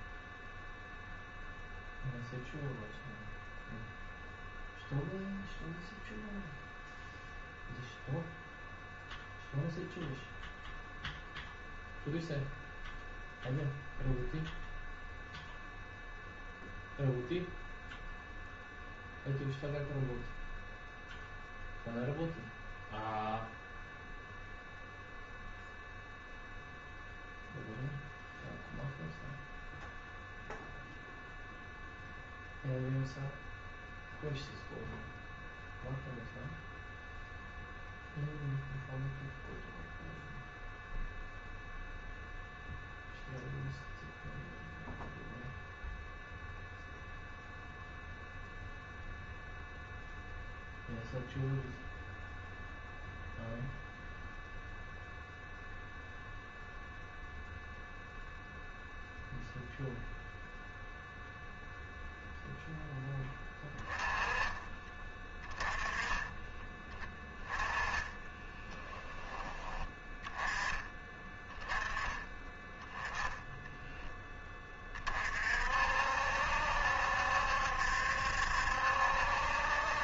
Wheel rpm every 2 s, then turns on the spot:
0, 0, 0, 0, 0, 0, 0, 0, 0, 0, 0, 0, 0, 0, 0, 0, 0, 0, 0, 0, 0, 0, 0, 0, 0, 0, 0, 0, 0, 0, 0, 0, 20, 10, 10, 10, 20, 20, 70, 70.
64-66 68-70